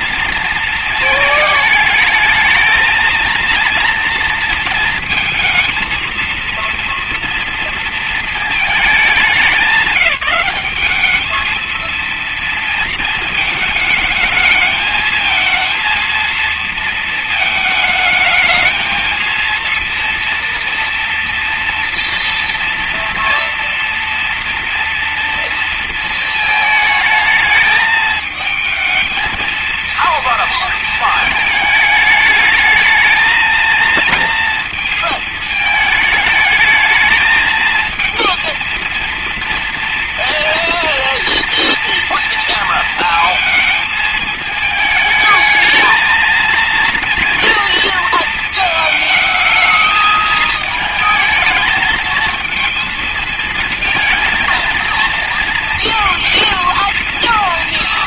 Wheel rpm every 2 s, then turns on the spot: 230, 220, 230, 230, 220, 190, 230, 220, 230, 220, 230, 230, 230, 220, 220, 230, 220, 230, 220, 230, 230, 220, 220, 230, 220, 220, 230, 230, 220.
none